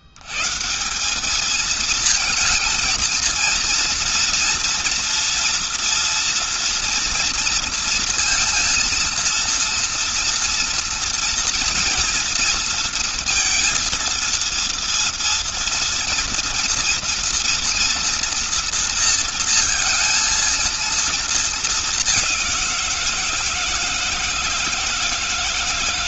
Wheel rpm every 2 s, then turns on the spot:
100, 230, 230, 230, 230, 230, 230, 230, 230, 230, 230, 190, 160.
none